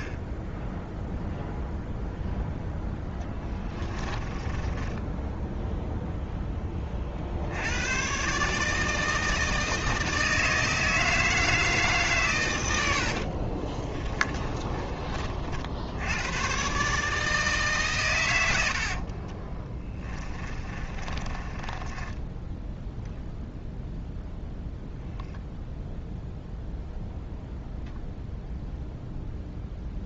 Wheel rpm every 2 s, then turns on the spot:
0, 10, 10, 30, 160, 160, 90, 30, 140, 60, 20, 0, 0, 0, 0.
4-6 12-16 18-22